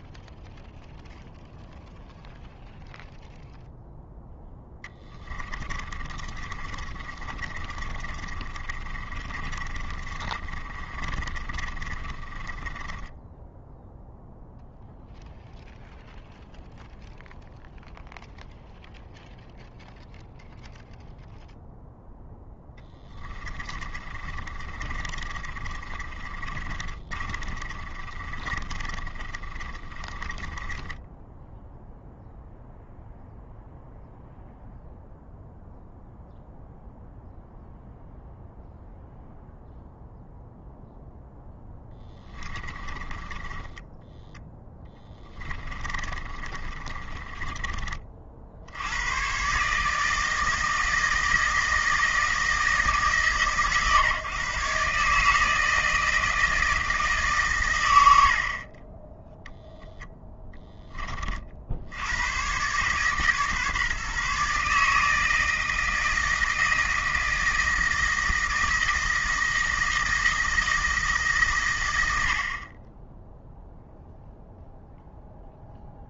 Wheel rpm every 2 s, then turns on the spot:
0, 0, 10, 30, 30, 30, 20, 0, 0, 0, 0, 10, 30, 30, 30, 20, 0, 0, 0, 0, 0, 20, 10, 30, 70, 160, 160, 140, 160, 40, 10, 130, 150, 160, 160, 160, 40, 0.
4-14 22-32 42-48